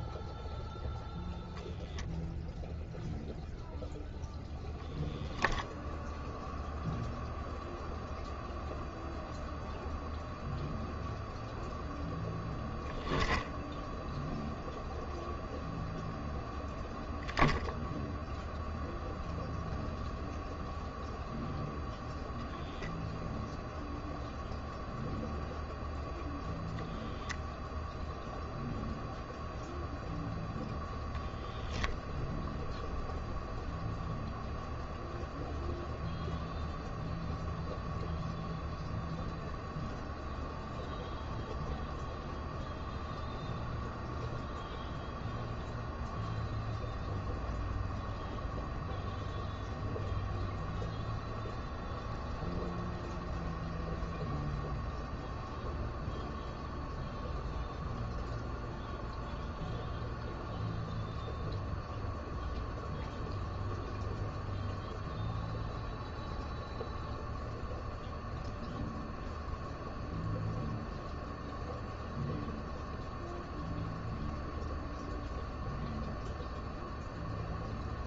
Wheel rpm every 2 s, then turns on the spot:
0, 0, 0, 0, 0, 0, 0, 0, 0, 0, 0, 0, 0, 0, 0, 0, 0, 0, 0, 0, 0, 0, 0, 0, 0, 0, 0, 0, 0, 0, 0, 0, 0, 0, 0, 0, 0, 0, 0.
none